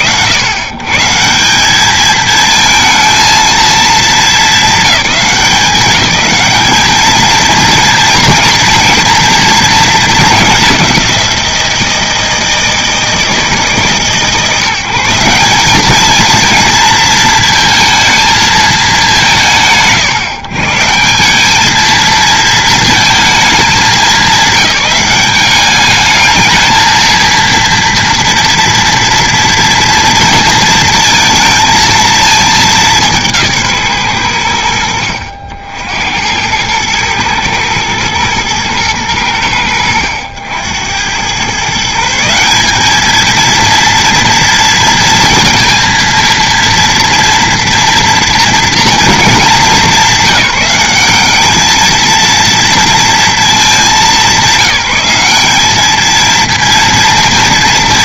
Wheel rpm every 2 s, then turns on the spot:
110, 220, 210, 220, 240, 190, 160, 170, 230, 170, 170, 220, 190, 220, 230, 230, 190, 60, 110, 100, 100, 210, 230, 230, 210, 190, 240, 190, 230.
none